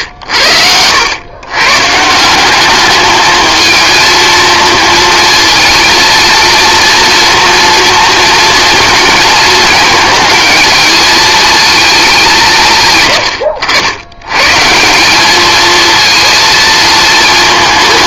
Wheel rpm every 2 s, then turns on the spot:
90, 210, 230, 230, 220, 220, 120, 170, 220.
none